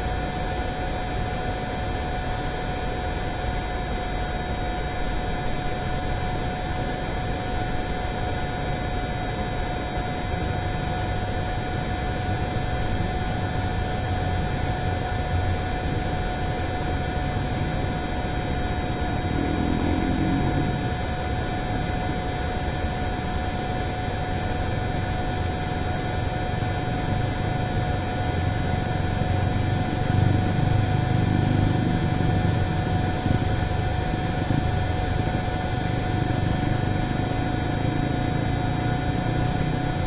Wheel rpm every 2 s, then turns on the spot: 0, 0, 0, 0, 0, 0, 0, 0, 0, 0, 0, 0, 0, 0, 0, 0, 0, 0, 0, 0.
none